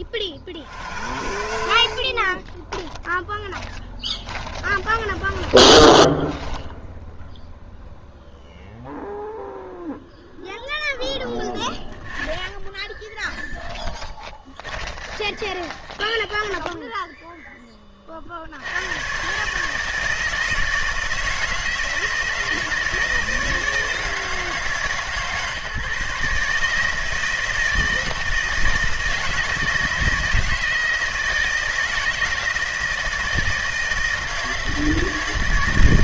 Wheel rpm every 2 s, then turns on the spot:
60, 20, 20, 0, 0, 0, 10, 20, 10, 90, 160, 160, 150, 150, 160, 160, 160, 160.
0-6 12-18